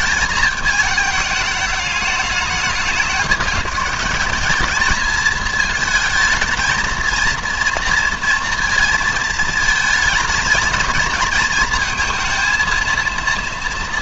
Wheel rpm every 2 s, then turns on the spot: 220, 200, 200, 220, 230, 220, 230.
none